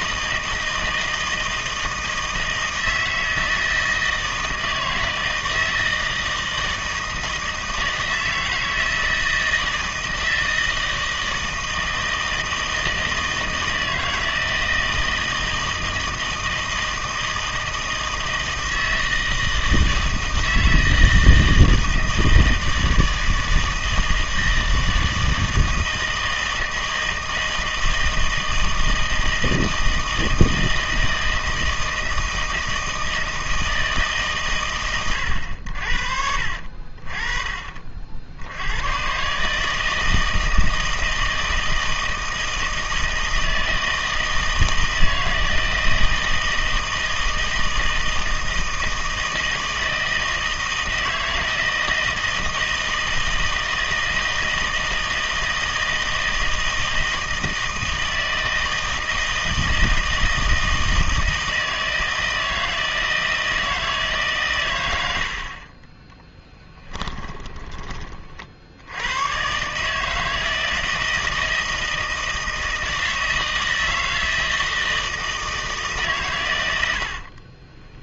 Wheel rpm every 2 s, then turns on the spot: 160, 160, 160, 160, 160, 160, 160, 160, 160, 160, 160, 160, 160, 160, 160, 160, 160, 130, 50, 100, 160, 160, 160, 160, 160, 160, 160, 160, 160, 160, 160, 160, 120, 10, 70, 160, 160, 160, 100.
66-68